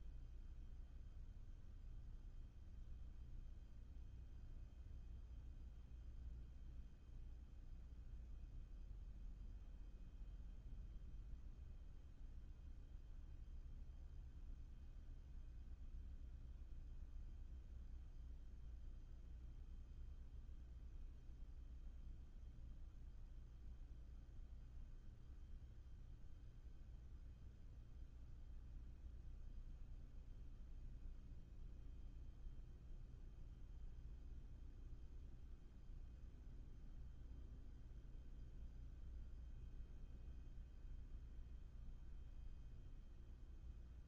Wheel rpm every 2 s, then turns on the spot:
0, 0, 0, 0, 0, 0, 0, 0, 0, 0, 0, 0, 0, 0, 0, 0, 0, 0, 0, 0, 0, 0.
none